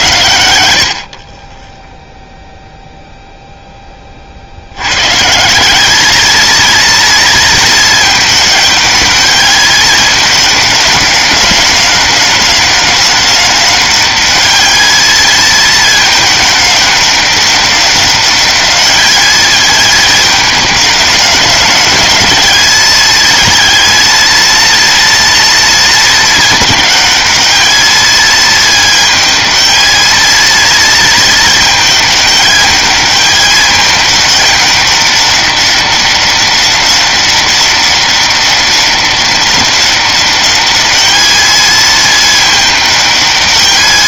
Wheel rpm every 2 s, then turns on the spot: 80, 0, 70, 220, 210, 200, 190, 210, 210, 200, 210, 210, 230, 220, 220, 220, 210, 210, 190, 190, 200, 210.
none